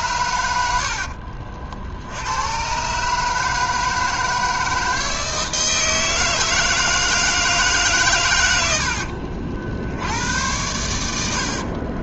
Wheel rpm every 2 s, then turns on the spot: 70, 130, 160, 160, 70, 90.
none